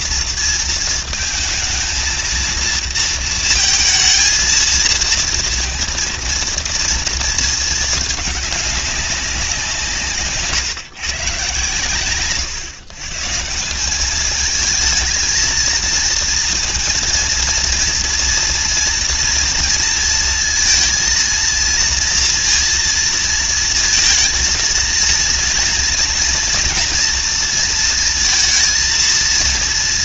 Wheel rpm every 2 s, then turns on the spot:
230, 230, 220, 230, 210, 140, 130, 210, 230, 230, 230, 230, 230, 240, 230.
none